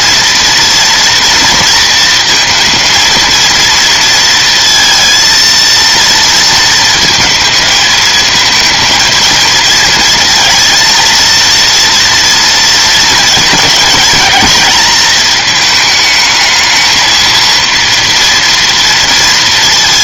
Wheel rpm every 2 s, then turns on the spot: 230, 230, 230, 220, 220, 230, 230, 220, 220, 230.
none